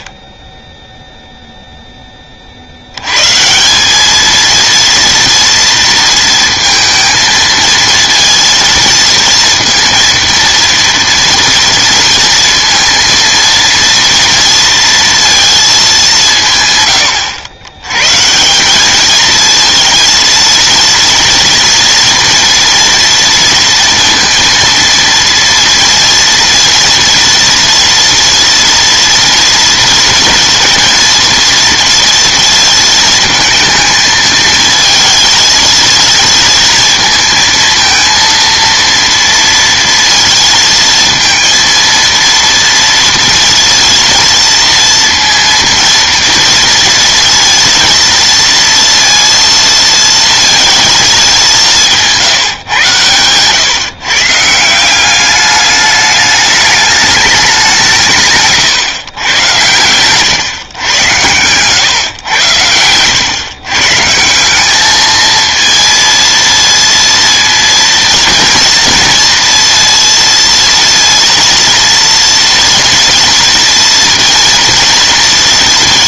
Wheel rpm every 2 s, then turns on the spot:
50, 70, 230, 230, 230, 230, 230, 230, 140, 200, 230, 230, 230, 230, 230, 230, 230, 230, 230, 230, 230, 230, 230, 230, 230, 220, 130, 170, 210, 140, 110, 100, 210, 230, 230, 230, 240, 230.
none